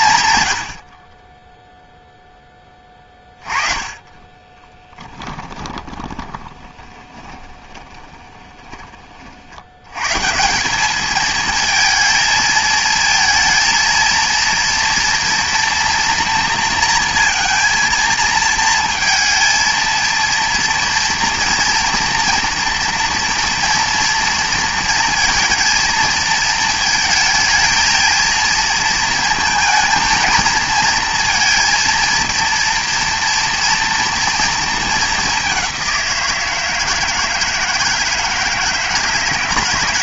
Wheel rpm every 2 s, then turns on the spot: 90, 20, 10, 20, 30, 200, 220, 240, 230, 230, 230, 230, 230, 220, 230, 230, 230, 210, 160, 160.
2-8